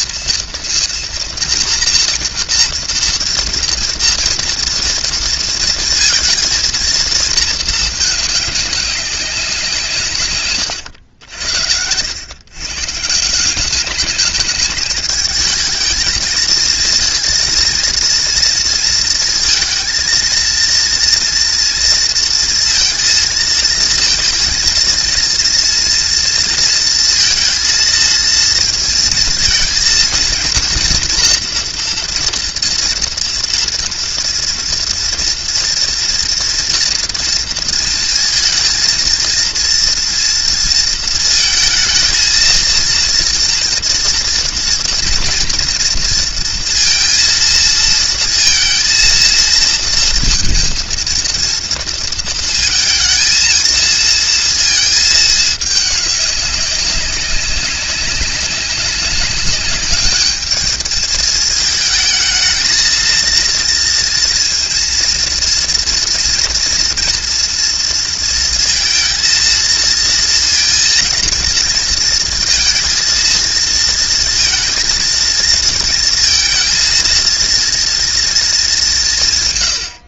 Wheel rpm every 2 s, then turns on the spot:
230, 230, 230, 230, 200, 120, 130, 210, 230, 230, 230, 230, 230, 230, 230, 230, 230, 230, 240, 230, 230, 230, 230, 230, 230, 220, 230, 220, 190, 190, 210, 220, 230, 230, 230, 230, 230, 230, 230, 210.
none